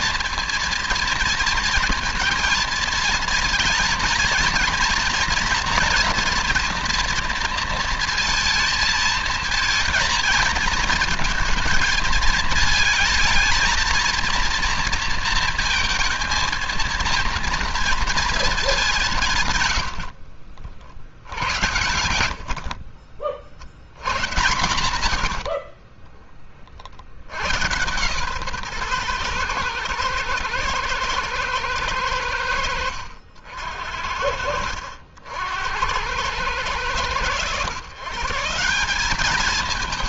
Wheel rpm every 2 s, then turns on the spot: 230, 230, 230, 240, 230, 230, 220, 230, 230, 200, 70, 70, 110, 50, 130, 110, 70, 60, 100, 180.
22-24